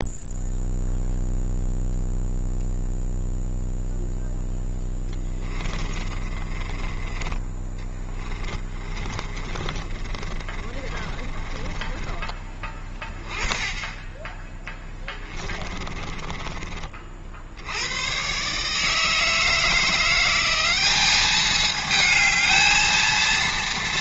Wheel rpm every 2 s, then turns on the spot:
0, 0, 10, 20, 30, 30, 20, 20, 40, 150, 200, 230.
4-12 14-16